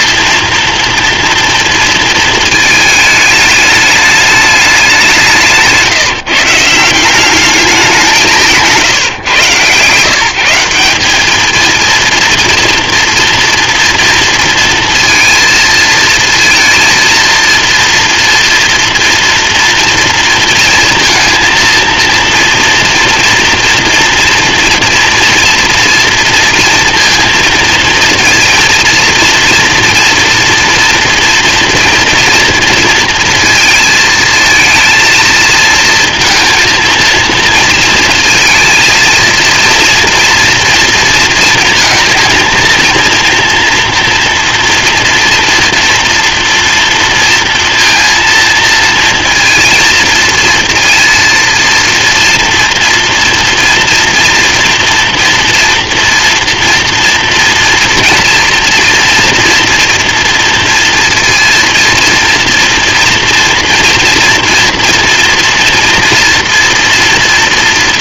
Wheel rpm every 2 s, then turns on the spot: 230, 220, 210, 160, 160, 180, 230, 230, 230, 240, 230, 230, 240, 240, 230, 230, 230, 220, 230, 230, 230, 230, 230, 230, 230, 230, 240, 230, 230, 230, 230, 230, 230, 240.
none